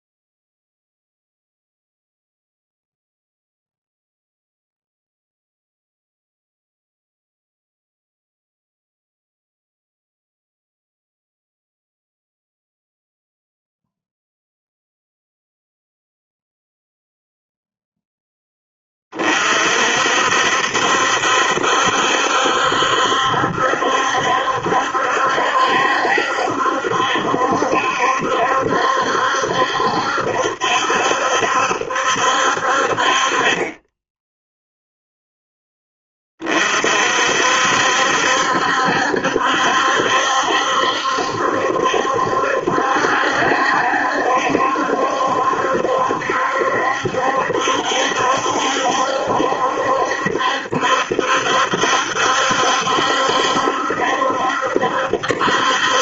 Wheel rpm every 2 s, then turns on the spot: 0, 0, 0, 0, 0, 0, 0, 0, 0, 20, 70, 70, 70, 70, 70, 70, 50, 0, 40, 70, 70, 70, 70, 70, 70, 70, 70, 70.
none